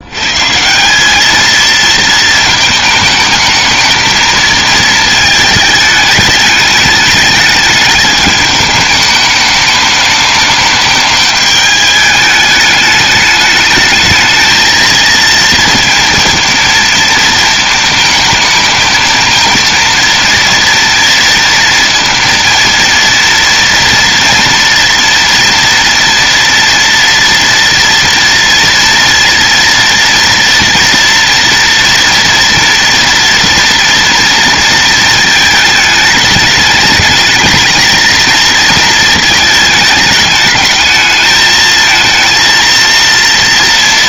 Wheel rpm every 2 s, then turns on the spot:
170, 220, 220, 210, 210, 210, 210, 220, 230, 220, 230, 230, 230, 230, 230, 230, 230, 230, 210, 220, 210, 230.
none